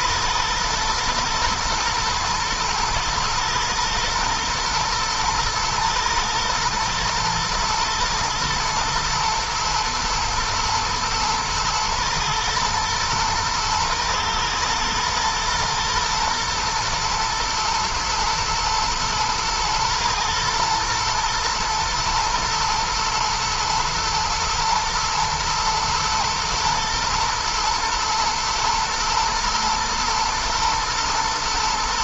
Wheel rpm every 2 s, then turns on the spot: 120, 110, 120, 110, 110, 110, 120, 110, 120, 120, 110, 110, 120, 120, 120, 120.
none